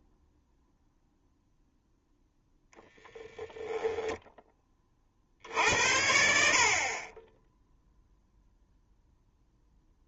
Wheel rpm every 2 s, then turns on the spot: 0, 10, 20, 30, 0.
none